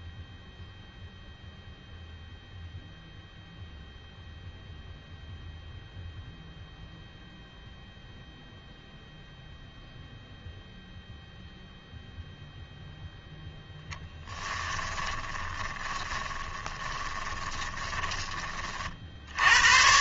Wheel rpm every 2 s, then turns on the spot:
0, 0, 0, 0, 0, 0, 0, 10, 10, 40.
14-18